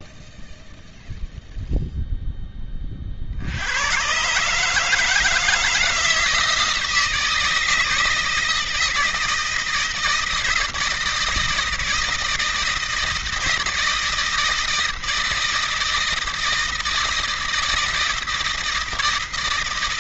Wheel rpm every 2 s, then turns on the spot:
0, 30, 150, 160, 160, 160, 160, 160, 160, 160.
none